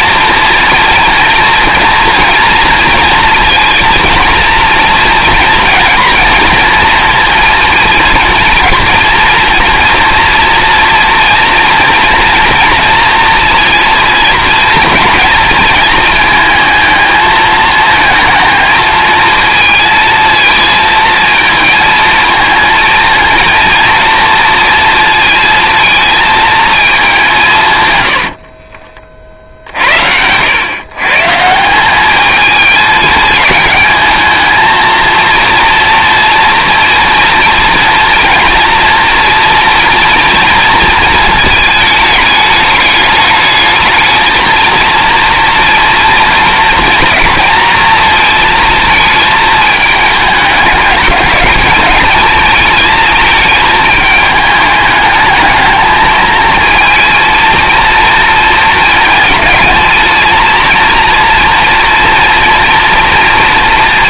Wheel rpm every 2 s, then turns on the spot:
230, 230, 230, 230, 230, 230, 230, 230, 220, 220, 220, 230, 230, 210, 40, 130, 220, 230, 230, 230, 230, 210, 230, 230, 230, 200, 220, 210, 230, 220, 230, 230.
none